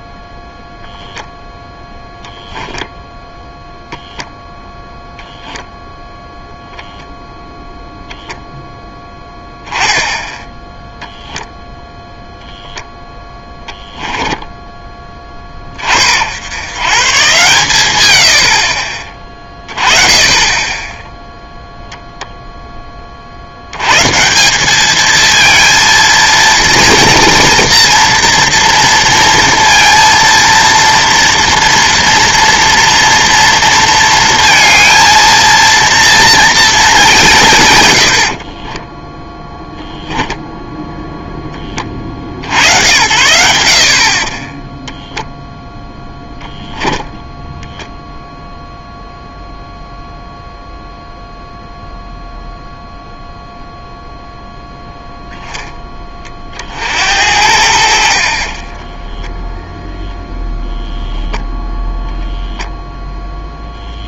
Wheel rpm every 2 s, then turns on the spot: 0, 0, 0, 0, 0, 10, 0, 10, 100, 60, 20, 10, 190, 230, 230, 230, 230, 230, 230, 40, 0, 80, 20, 10, 0, 0, 0, 0, 50, 40, 0, 0.
14-16 38-40 44-48 58-60